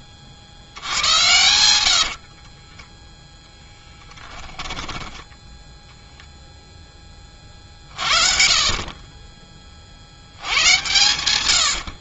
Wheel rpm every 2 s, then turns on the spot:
80, 30, 10, 0, 50, 110.
2-4